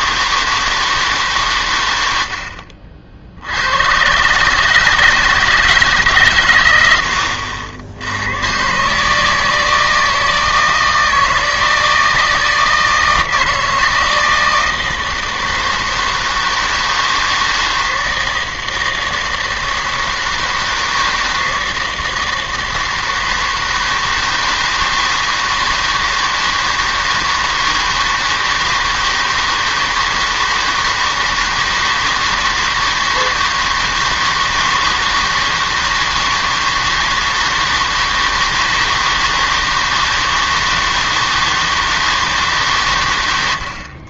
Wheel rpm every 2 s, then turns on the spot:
160, 60, 150, 90, 130, 160, 160, 160, 160, 160, 160, 160, 160, 160, 160, 160, 160, 160, 160, 160, 160, 140.
none